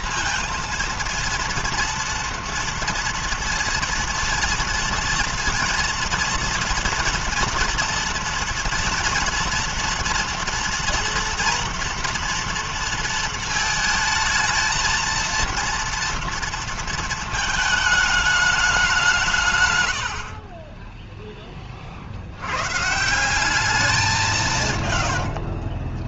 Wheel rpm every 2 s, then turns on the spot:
230, 230, 230, 230, 230, 230, 230, 220, 230, 210, 50, 90, 160.
none